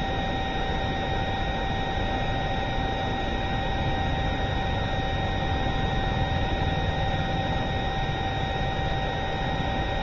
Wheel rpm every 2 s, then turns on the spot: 0, 0, 0, 0, 0.
none